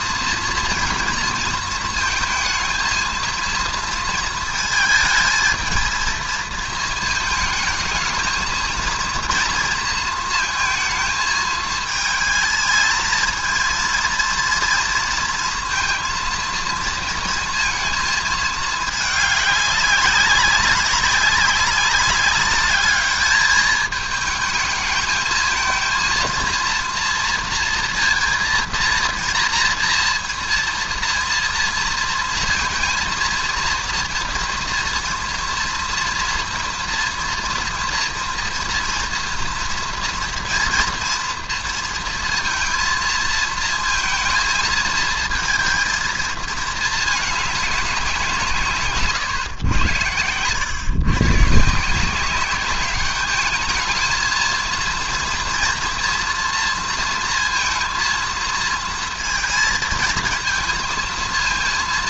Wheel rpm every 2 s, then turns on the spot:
230, 220, 220, 220, 230, 220, 220, 230, 230, 220, 200, 210, 220, 230, 230, 230, 230, 230, 230, 230, 230, 230, 230, 220, 150, 120, 200, 230, 230, 230, 230.
none